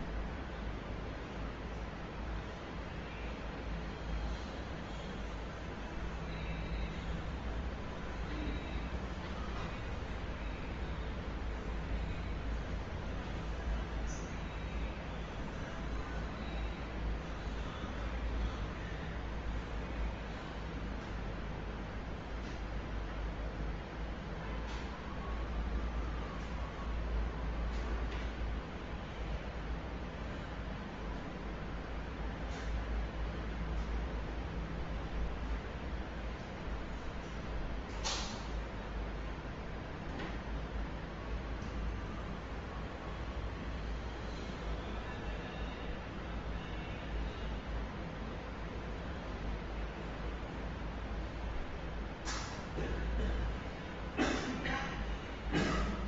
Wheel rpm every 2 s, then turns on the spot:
0, 0, 0, 0, 0, 0, 0, 0, 0, 0, 0, 0, 0, 0, 0, 0, 0, 0, 0, 0, 0, 0, 0, 0, 0, 0, 0, 0.
none